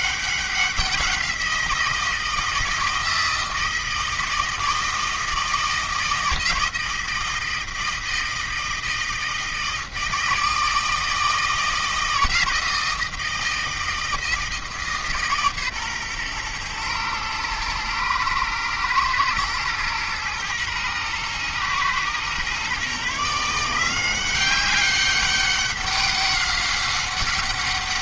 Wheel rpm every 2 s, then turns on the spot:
180, 160, 160, 160, 160, 160, 170, 150, 120, 110, 120, 130, 190, 190.
none